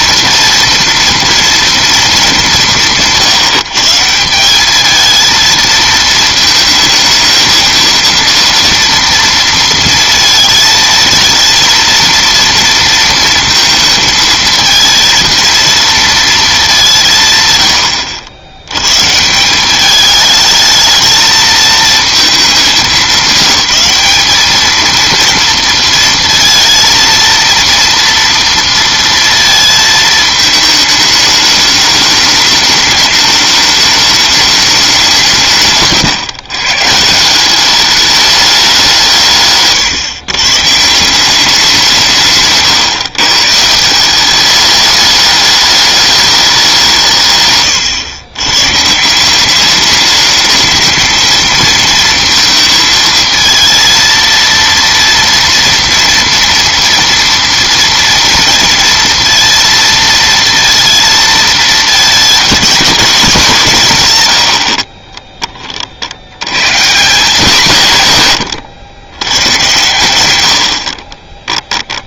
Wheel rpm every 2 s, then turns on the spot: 230, 190, 200, 220, 230, 220, 230, 230, 190, 110, 210, 210, 220, 230, 230, 210, 210, 200, 140, 190, 150, 140, 210, 180, 140, 220, 230, 230, 230, 230, 230, 220, 60, 140, 110, 60.
none